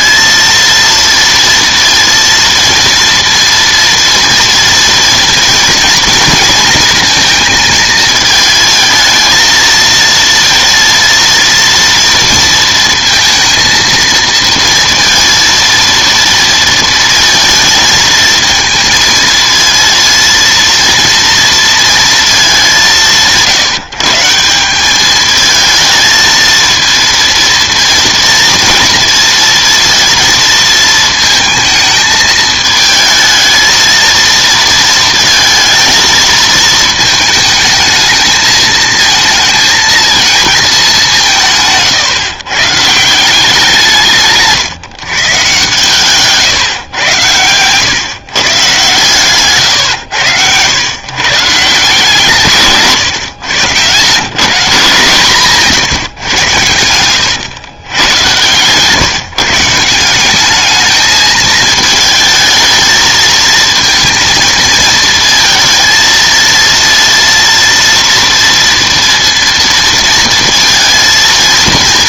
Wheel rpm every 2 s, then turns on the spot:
230, 230, 230, 230, 220, 230, 230, 230, 230, 220, 230, 180, 190, 230, 230, 230, 220, 230, 220, 220, 210, 140, 140, 130, 130, 110, 150, 150, 110, 130, 210, 220, 230, 230, 230, 230.
44-46